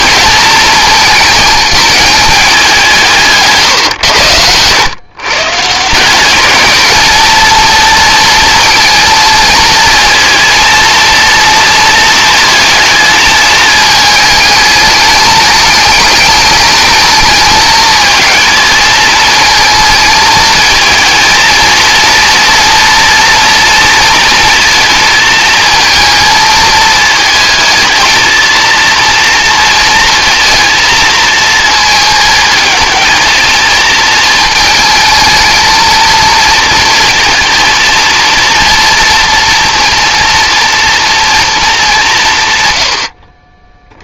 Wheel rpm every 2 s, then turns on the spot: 220, 180, 120, 210, 230, 240, 220, 210, 220, 220, 230, 240, 230, 220, 230, 230, 220, 220, 230, 230, 230, 90.
none